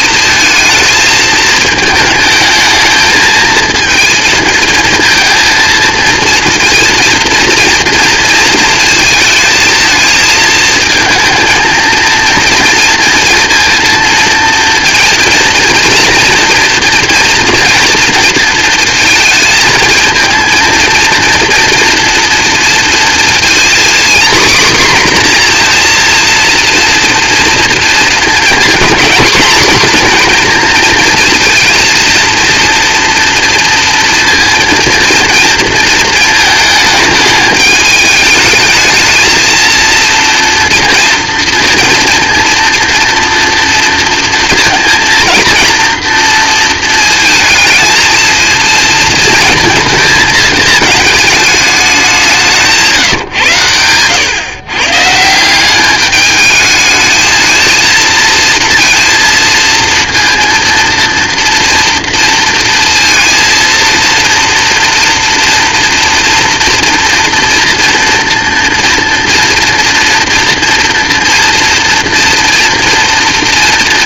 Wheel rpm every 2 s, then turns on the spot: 220, 220, 220, 230, 230, 230, 230, 240, 230, 230, 230, 230, 260, 230, 230, 230, 230, 230, 220, 220, 230, 230, 230, 230, 230, 210, 160, 140, 220, 230, 230, 230, 230, 230, 230, 240, 230.
none